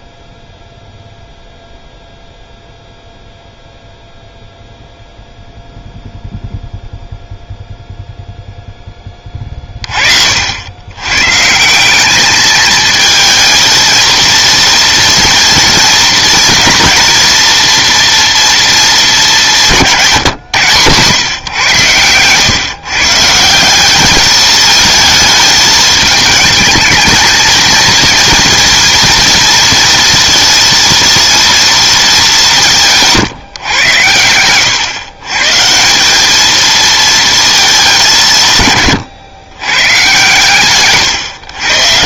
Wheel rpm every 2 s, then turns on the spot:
0, 0, 0, 0, 10, 90, 220, 230, 230, 220, 120, 130, 220, 220, 230, 230, 170, 110, 220, 140, 120.
none